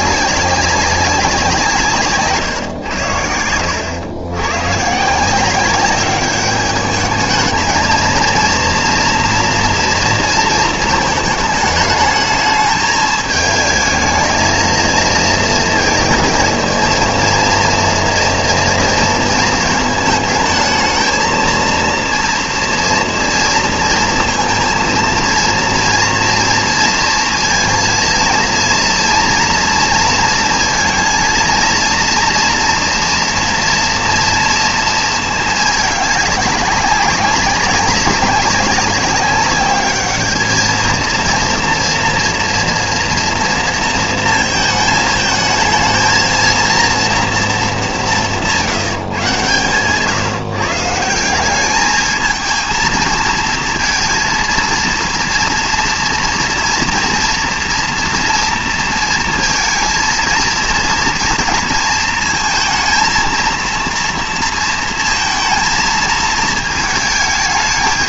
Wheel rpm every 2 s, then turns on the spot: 200, 130, 120, 210, 230, 230, 220, 220, 230, 230, 220, 230, 230, 230, 230, 230, 230, 230, 200, 200, 220, 230, 220, 230, 180, 150, 220, 230, 230, 230, 230, 230, 230, 220.
2-4